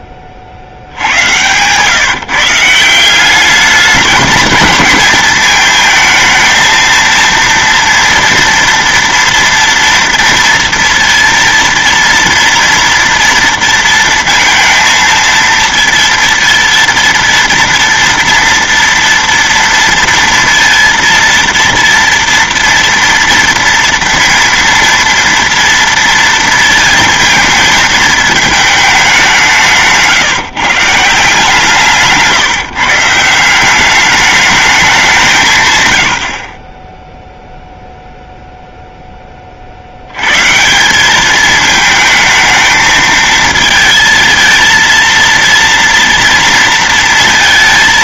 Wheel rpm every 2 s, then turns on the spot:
70, 170, 220, 230, 240, 230, 230, 230, 230, 230, 230, 230, 230, 230, 210, 150, 150, 210, 40, 0, 150, 220, 230, 230.
none